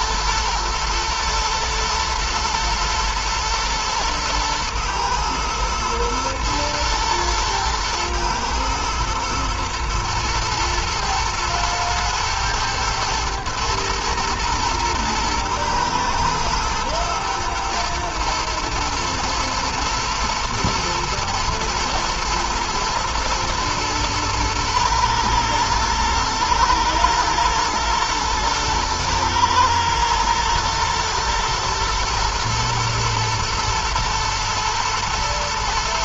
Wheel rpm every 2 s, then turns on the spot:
110, 110, 110, 120, 110, 110, 110, 120, 120, 120, 120, 110, 110, 120, 110, 110, 110, 120.
none